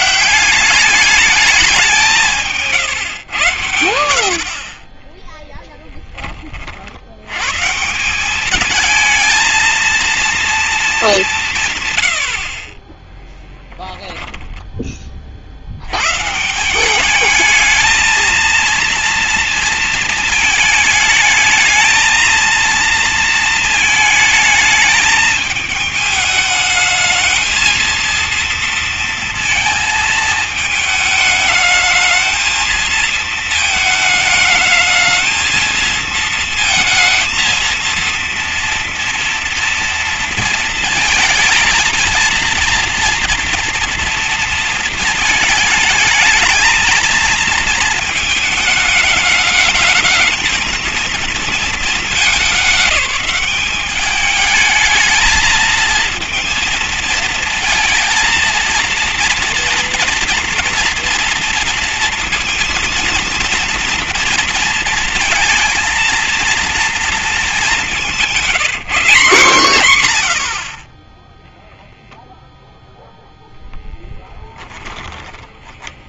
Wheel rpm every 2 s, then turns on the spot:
210, 130, 10, 90, 220, 190, 10, 30, 200, 230, 220, 230, 220, 220, 230, 220, 220, 220, 230, 230, 220, 230, 220, 230, 220, 220, 200, 220, 230, 230, 230, 230, 230, 230, 190, 20, 0, 10.
4-6 12-14 74-76